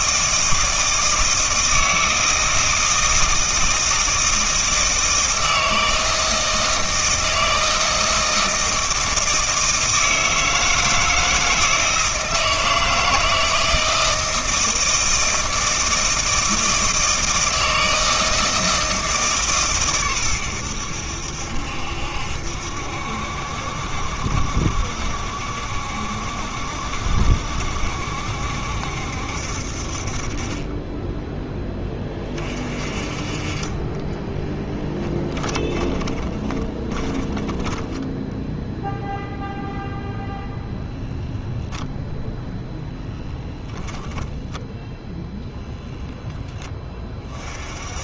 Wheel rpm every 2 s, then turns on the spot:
160, 160, 160, 160, 160, 160, 160, 160, 160, 160, 90, 70, 70, 70, 70, 20, 40, 10, 20, 0, 0, 0, 0, 10.
34-38